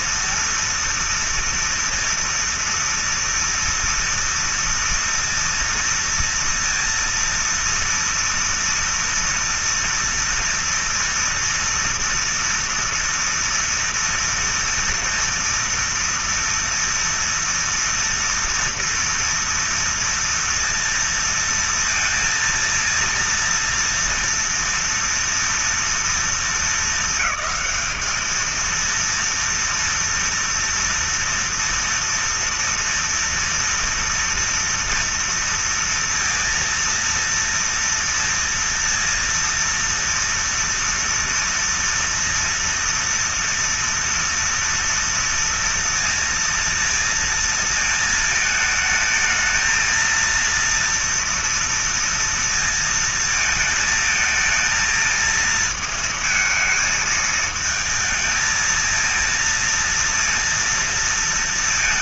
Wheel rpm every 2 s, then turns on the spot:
230, 230, 230, 230, 240, 240, 230, 230, 230, 230, 230, 230, 230, 230, 220, 230, 230, 240, 230, 230, 230, 230, 230, 230, 220, 230, 230, 220, 220, 230, 230.
none